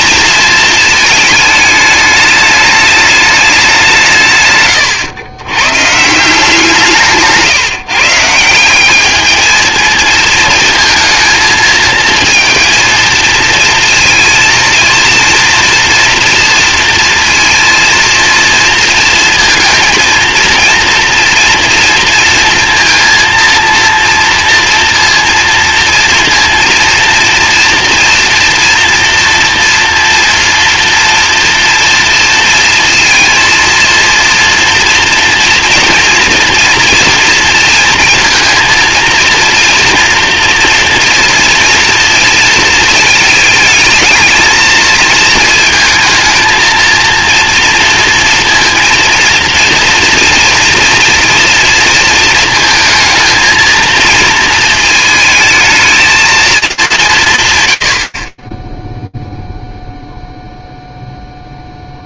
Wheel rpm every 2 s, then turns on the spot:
220, 210, 130, 170, 170, 220, 230, 230, 230, 230, 230, 230, 230, 230, 240, 230, 230, 230, 230, 230, 230, 230, 220, 230, 230, 230, 230, 220, 220, 30, 0.
none